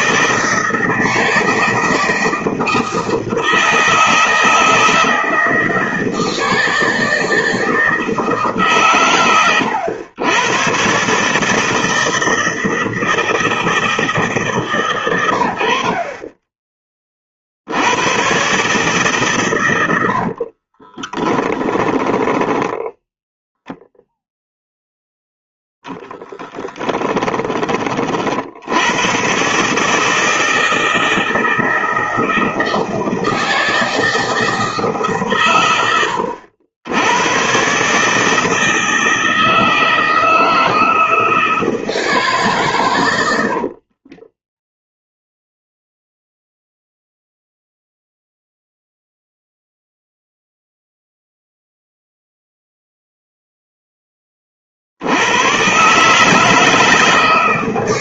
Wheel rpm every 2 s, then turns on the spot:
160, 160, 160, 160, 150, 110, 160, 140, 20, 140, 50, 10, 0, 10, 70, 160, 160, 160, 90, 160, 160, 140, 20, 0, 0, 0, 0, 30, 150.
20-24 26-28 44-46